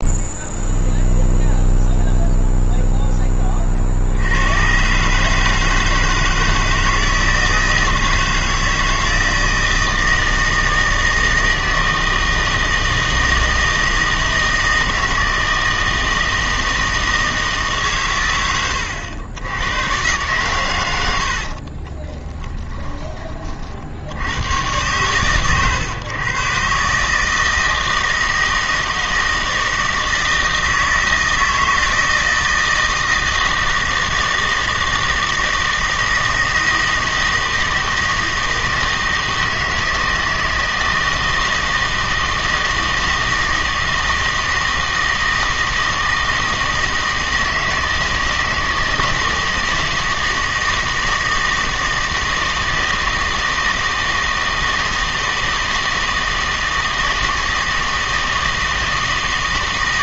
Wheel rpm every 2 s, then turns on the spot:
0, 0, 110, 160, 160, 160, 160, 160, 160, 100, 110, 20, 100, 140, 160, 160, 160, 160, 160, 160, 160, 160, 160, 160, 160, 160, 160, 160, 160, 160.
22-24